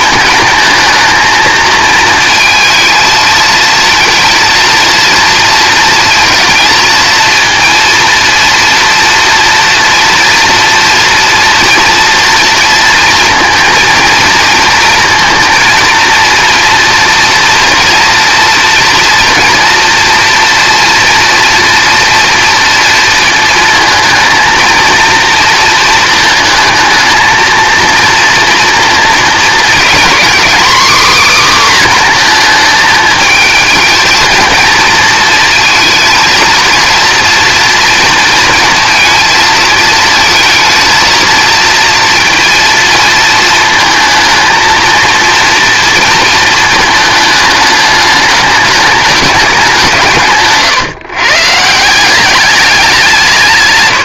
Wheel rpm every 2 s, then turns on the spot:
220, 230, 230, 230, 230, 230, 230, 230, 230, 230, 230, 230, 230, 220, 230, 260, 220, 220, 230, 230, 230, 230, 230, 220, 210, 140, 180.
none